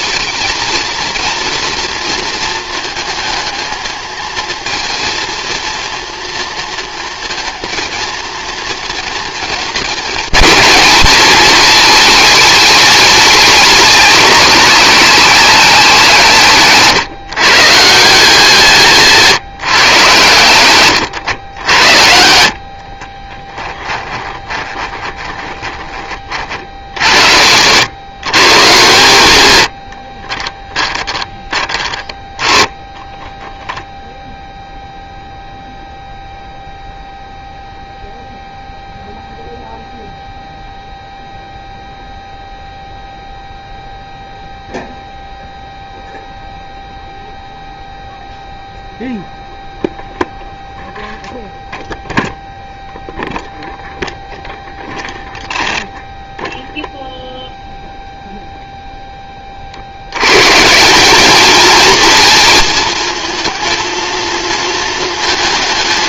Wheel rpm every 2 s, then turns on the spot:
230, 220, 230, 230, 230, 220, 210, 180, 140, 160, 110, 40, 20, 70, 130, 10, 10, 0, 0, 0, 0, 0, 0, 0, 0, 0, 0, 0, 0, 0, 190, 230, 230.
22-26